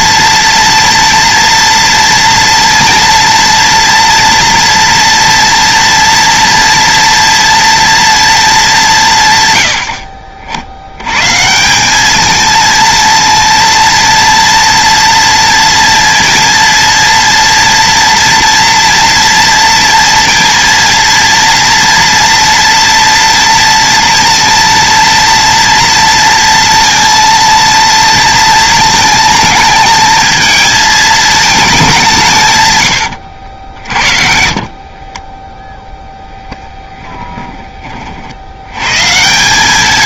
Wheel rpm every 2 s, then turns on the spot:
230, 230, 240, 230, 150, 120, 230, 230, 230, 230, 230, 230, 230, 230, 220, 220, 100, 30, 10, 130.
32-36